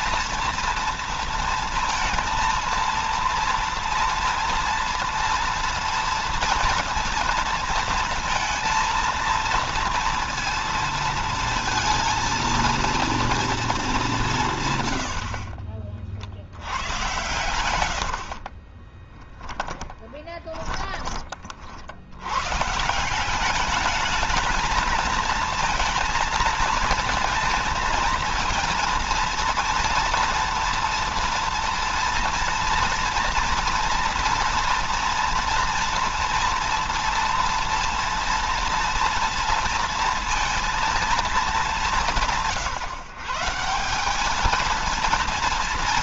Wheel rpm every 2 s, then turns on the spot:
230, 230, 230, 230, 230, 230, 230, 120, 100, 40, 20, 140, 220, 230, 230, 230, 230, 240, 230, 240, 230, 160, 220.
14-16 18-20